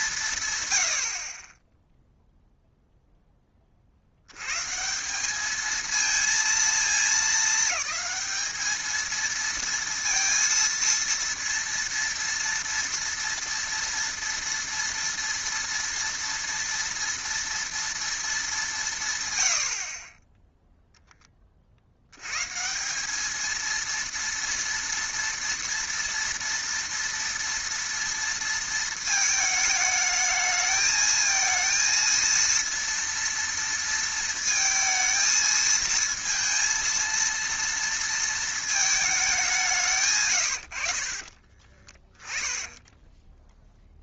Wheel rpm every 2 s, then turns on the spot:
110, 0, 130, 230, 220, 230, 230, 230, 230, 190, 0, 150, 230, 230, 230, 220, 230, 230, 230, 230, 100, 20.
42-44